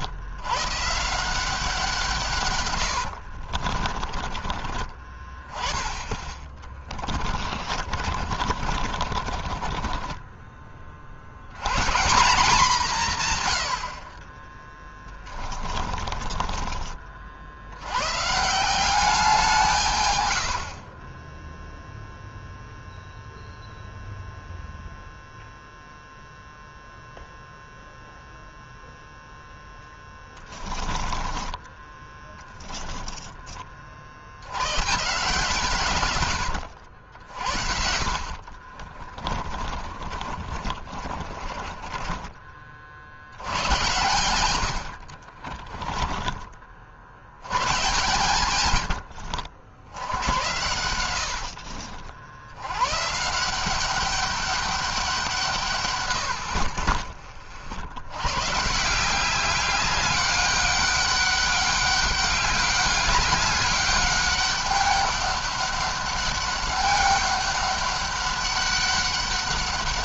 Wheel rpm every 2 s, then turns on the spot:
150, 90, 30, 20, 50, 40, 150, 20, 40, 180, 30, 0, 0, 0, 0, 20, 10, 140, 80, 50, 30, 60, 70, 60, 110, 90, 130, 190, 50, 170, 200, 200, 200, 200, 200.
2-4 6-10 14-16 20-22 30-32 38-42 44-46 48-52 56-58